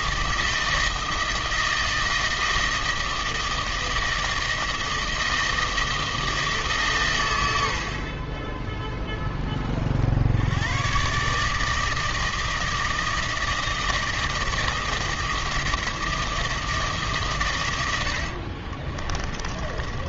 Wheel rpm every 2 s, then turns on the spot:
160, 160, 160, 140, 10, 120, 160, 160, 150, 30.
18-20